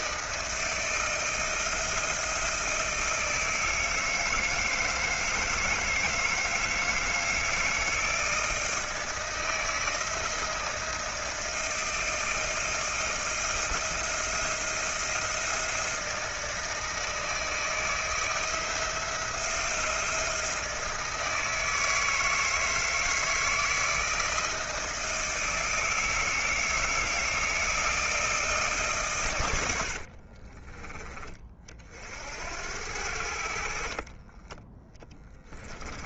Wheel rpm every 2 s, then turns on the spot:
160, 160, 160, 160, 160, 160, 160, 160, 160, 170, 160, 160, 160, 160, 130, 20, 80, 20.
none